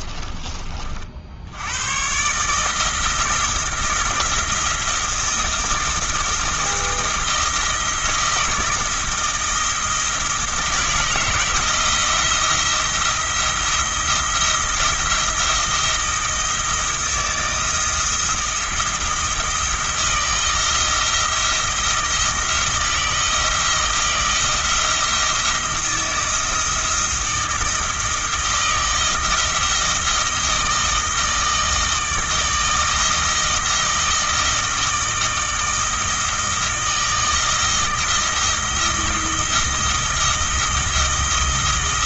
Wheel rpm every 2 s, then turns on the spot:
40, 160, 170, 170, 160, 160, 170, 170, 160, 170, 170, 160, 170, 170, 160, 160, 160, 160, 160, 160, 170.
none